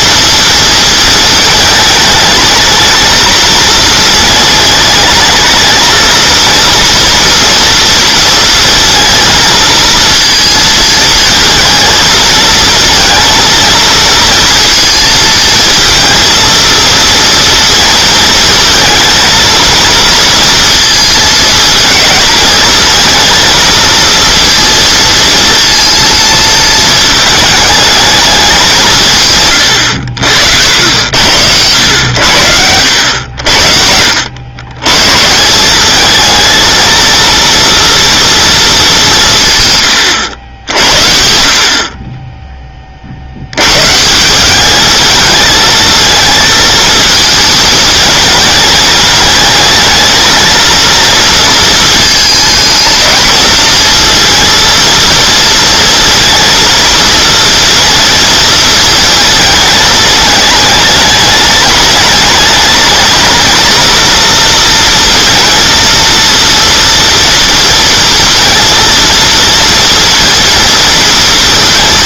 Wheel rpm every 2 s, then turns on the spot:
220, 220, 220, 230, 230, 230, 220, 230, 230, 230, 230, 220, 230, 230, 200, 70, 90, 100, 230, 220, 70, 20, 200, 230, 220, 230, 220, 230, 230, 230, 210, 220, 230, 230, 230, 230.
none